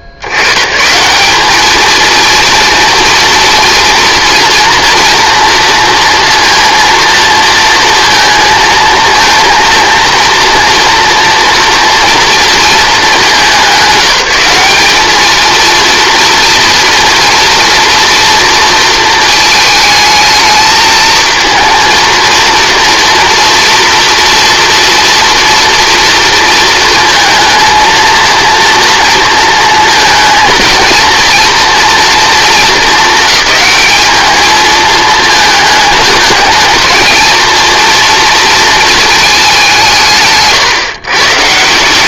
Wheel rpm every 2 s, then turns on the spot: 80, 230, 240, 230, 230, 230, 230, 200, 230, 230, 220, 230, 230, 220, 230, 230, 230, 220, 220, 230, 130.
none